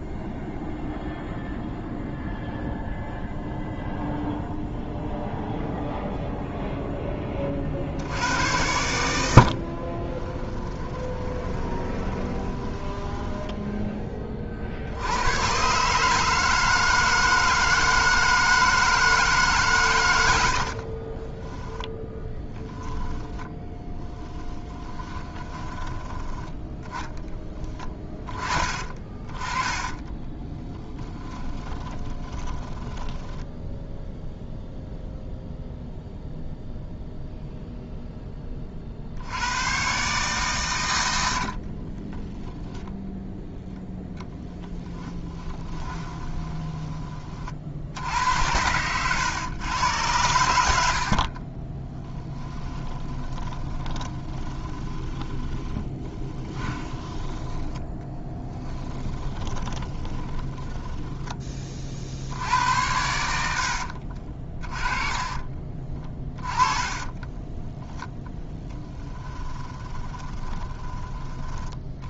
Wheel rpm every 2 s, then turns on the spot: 0, 0, 0, 0, 100, 20, 10, 70, 160, 160, 50, 10, 20, 10, 30, 10, 10, 0, 0, 50, 110, 0, 10, 20, 100, 80, 10, 10, 20, 10, 10, 80, 30, 20, 10, 20.
10-14 20-26 30-34 44-46 48-62 64-72